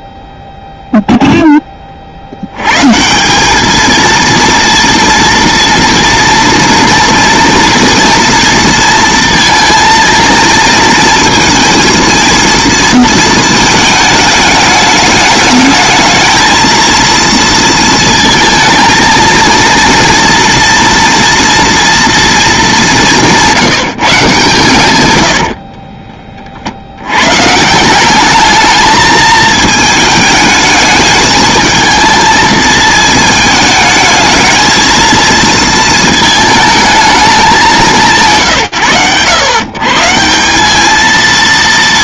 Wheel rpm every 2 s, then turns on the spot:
0, 120, 230, 240, 230, 230, 230, 210, 220, 220, 230, 200, 120, 50, 220, 210, 220, 220, 220, 120, 210.
none